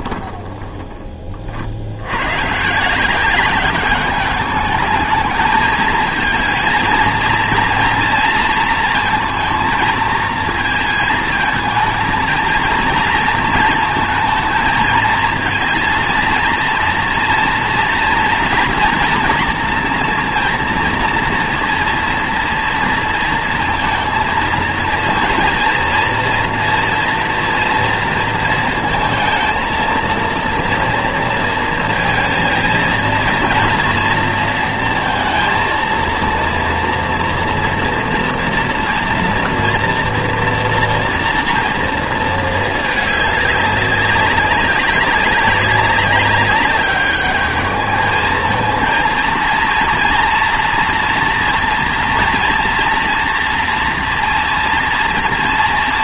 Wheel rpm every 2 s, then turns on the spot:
20, 140, 210, 230, 230, 230, 230, 230, 230, 230, 230, 240, 230, 240, 220, 230, 230, 230, 240, 230, 240, 220, 200, 200, 220, 230, 230, 230.
0-2